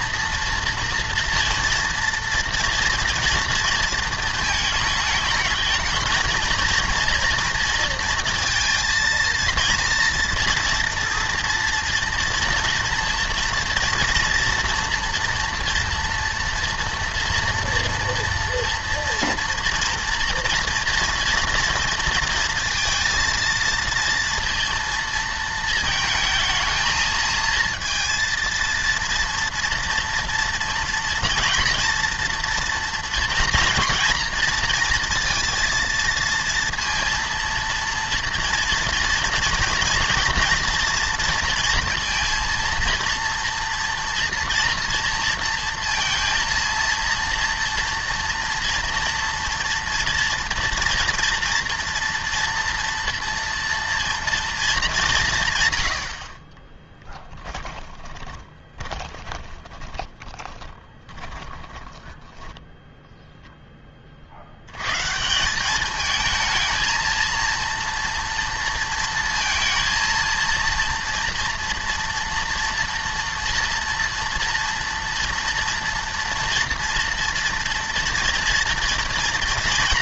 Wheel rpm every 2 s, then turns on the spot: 230, 230, 220, 230, 230, 230, 230, 230, 230, 230, 230, 230, 230, 220, 230, 230, 240, 230, 230, 230, 230, 230, 230, 230, 240, 230, 230, 210, 10, 20, 30, 10, 100, 230, 230, 230, 230, 230, 230, 230.
56-62